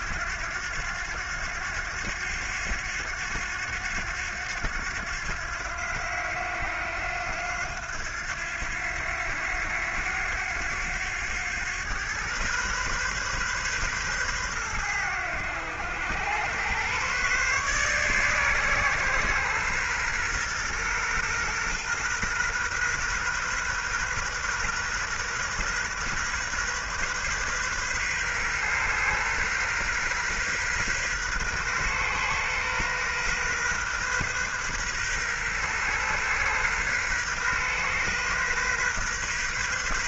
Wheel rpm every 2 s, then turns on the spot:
90, 90, 90, 90, 90, 100, 130, 100, 130, 130, 120, 120, 130, 130, 130, 130, 130, 130, 130, 120.
none